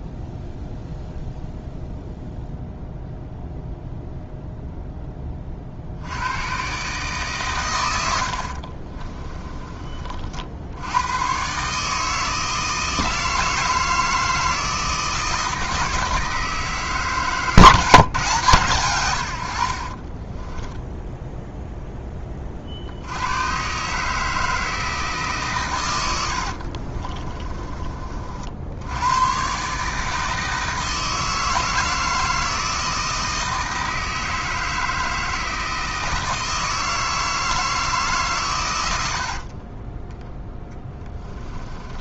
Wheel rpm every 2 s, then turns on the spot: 0, 0, 10, 130, 40, 80, 160, 160, 150, 130, 10, 60, 160, 40, 80, 160, 160, 160, 160, 100, 10.
8-10 20-22 26-28 40-42